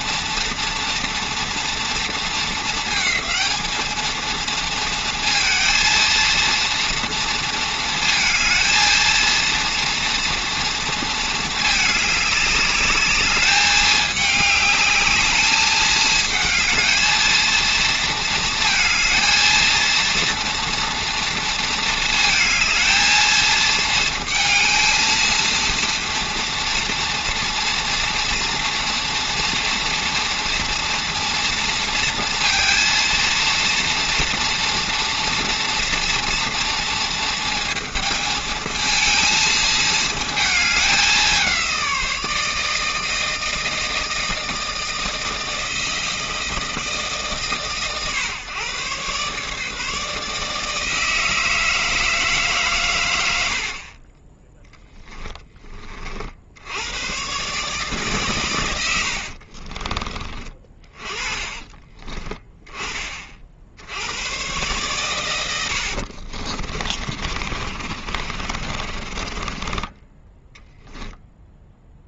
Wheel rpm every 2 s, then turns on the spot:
240, 220, 230, 230, 230, 230, 210, 210, 220, 220, 230, 220, 230, 230, 230, 230, 230, 230, 230, 220, 210, 160, 160, 160, 130, 160, 130, 10, 90, 90, 30, 20, 120, 50, 40, 0.
60-62 66-70